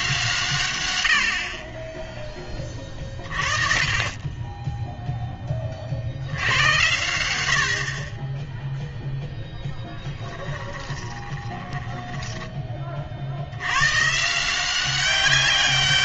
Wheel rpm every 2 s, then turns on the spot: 130, 20, 20, 100, 10, 20, 20, 170.
10-12